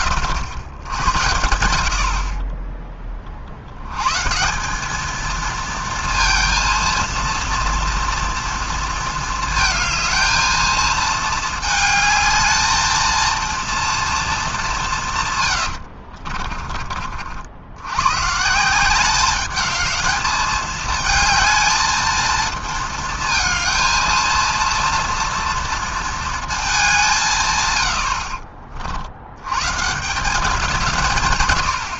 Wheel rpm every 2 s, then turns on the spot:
80, 10, 200, 230, 230, 220, 220, 200, 40, 170, 220, 230, 230, 210, 50, 170.
16-18